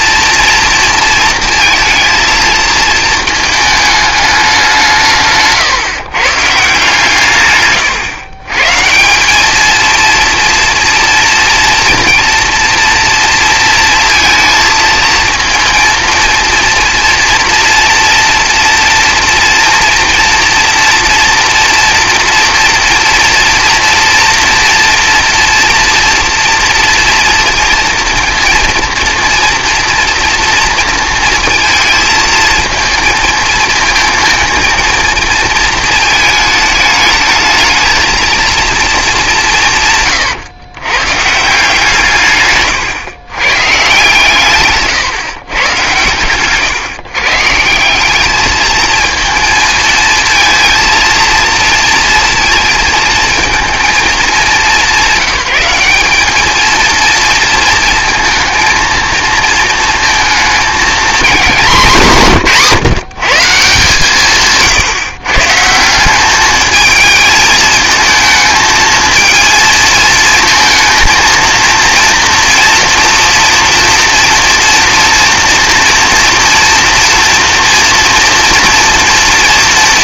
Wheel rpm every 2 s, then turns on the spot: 230, 230, 180, 150, 140, 240, 230, 230, 230, 230, 230, 230, 230, 230, 230, 230, 230, 230, 210, 230, 120, 140, 140, 140, 220, 230, 230, 200, 220, 230, 230, 170, 140, 210, 220, 230, 240, 230, 240, 230.
none